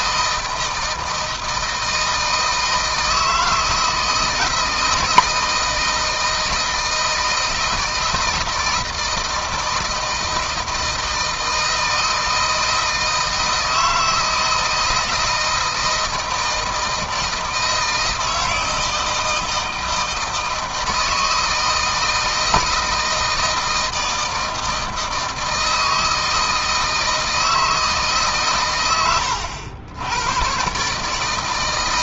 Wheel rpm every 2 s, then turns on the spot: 160, 160, 160, 160, 160, 160, 160, 160, 160, 160, 160, 160, 160, 160, 110, 140.
none